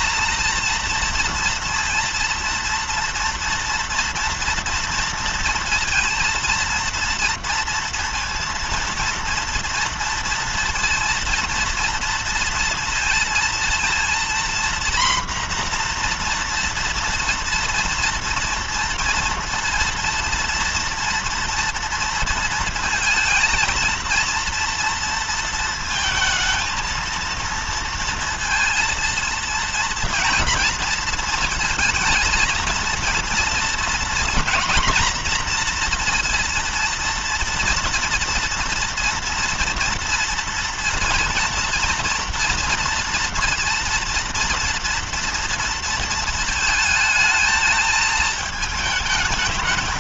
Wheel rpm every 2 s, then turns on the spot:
230, 230, 230, 230, 230, 230, 230, 230, 240, 230, 230, 230, 230, 220, 230, 230, 230, 240, 240, 230, 230, 230, 230, 230, 220.
none